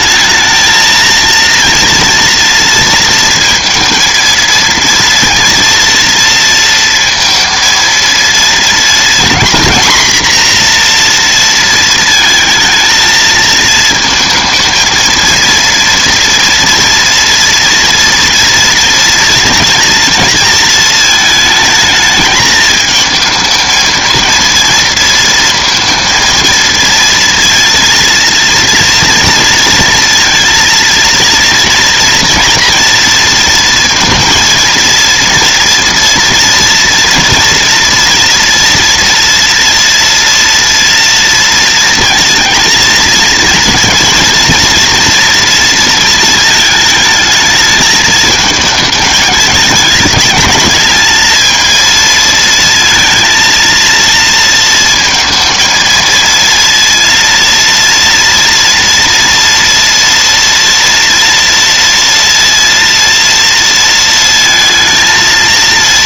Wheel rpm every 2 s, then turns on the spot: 220, 230, 230, 230, 230, 240, 220, 220, 230, 230, 220, 210, 230, 230, 230, 230, 240, 230, 230, 230, 230, 230, 230, 220, 210, 210, 230, 230, 230, 230, 230, 230, 230.
none